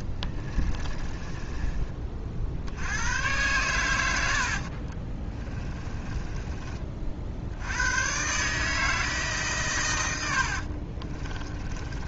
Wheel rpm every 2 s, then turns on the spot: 20, 80, 50, 30, 150, 60.
0-2 4-6 10-12